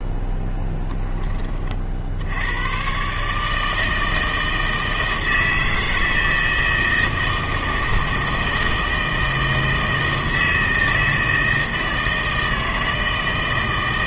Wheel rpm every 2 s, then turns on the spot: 10, 100, 160, 160, 160, 160, 160.
none